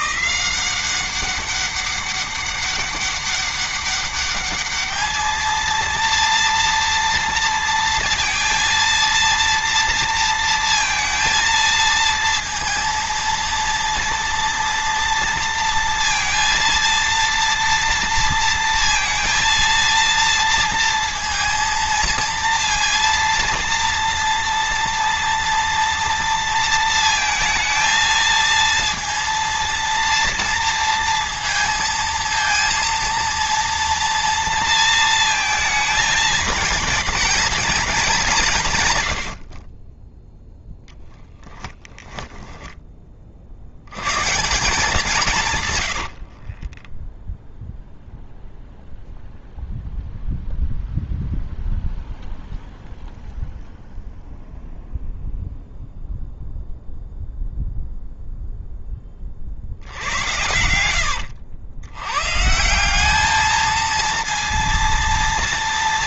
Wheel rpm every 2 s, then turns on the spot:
190, 200, 210, 230, 230, 230, 230, 230, 230, 230, 230, 230, 230, 230, 230, 230, 230, 230, 230, 170, 0, 10, 170, 60, 0, 0, 0, 0, 0, 0, 90, 150, 230.
42-44 46-48